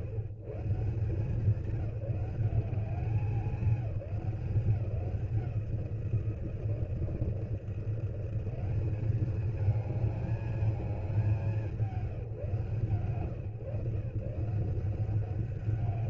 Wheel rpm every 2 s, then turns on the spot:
140, 190, 180, 170, 190, 220, 170, 170.
none